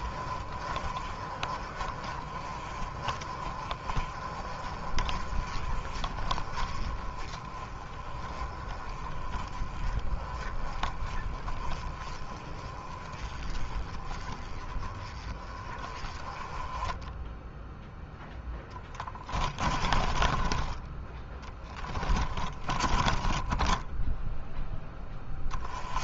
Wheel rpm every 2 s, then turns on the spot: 30, 30, 30, 30, 20, 20, 20, 20, 20, 10, 20, 10, 10.
16-20 22-24